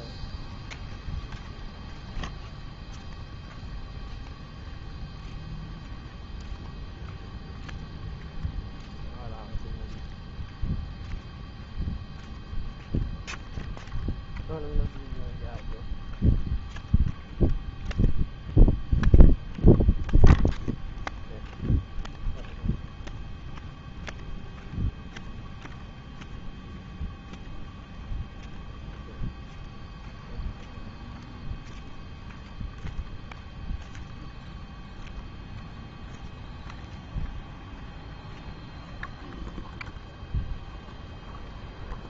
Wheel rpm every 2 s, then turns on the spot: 0, 0, 0, 0, 0, 0, 0, 0, 0, 0, 0, 0, 0, 0, 0, 0, 0, 0, 0, 0, 0.
none